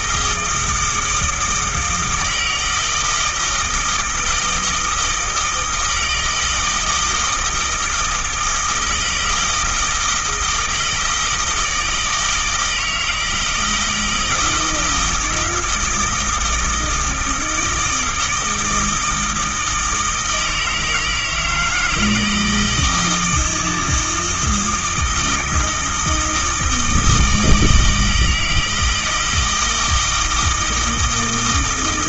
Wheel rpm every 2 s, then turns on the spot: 160, 160, 160, 160, 160, 170, 160, 160, 160, 160, 160, 160, 160, 160, 160, 160.
none